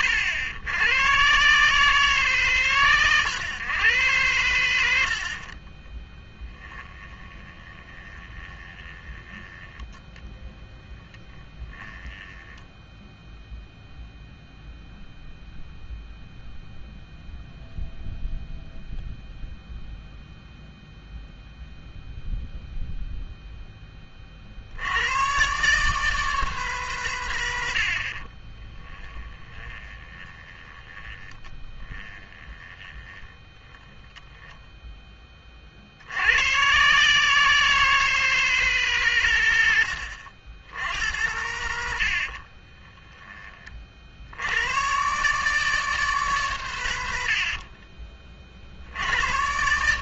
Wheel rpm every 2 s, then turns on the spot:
100, 130, 80, 10, 20, 10, 10, 0, 0, 0, 0, 0, 70, 150, 30, 20, 20, 10, 120, 160, 100, 40, 120, 120, 60.
6-14 28-36 42-44